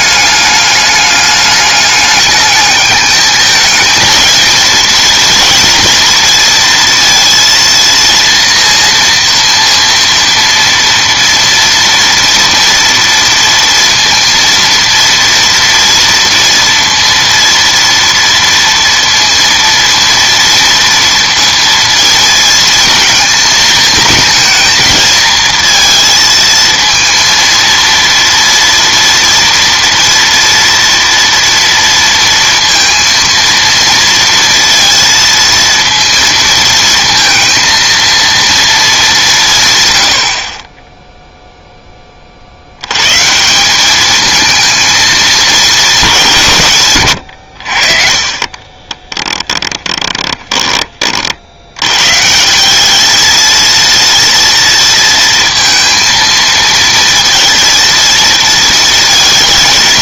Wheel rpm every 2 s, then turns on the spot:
210, 210, 230, 230, 230, 230, 230, 230, 230, 230, 230, 220, 220, 230, 230, 230, 230, 230, 230, 220, 30, 70, 220, 140, 30, 20, 190, 230, 230, 230.
48-50